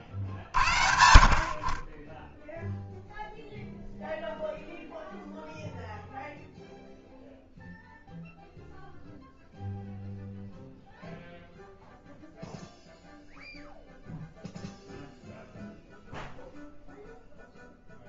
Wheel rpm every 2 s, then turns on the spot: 50, 0, 0, 0, 0, 0, 0, 0, 0.
none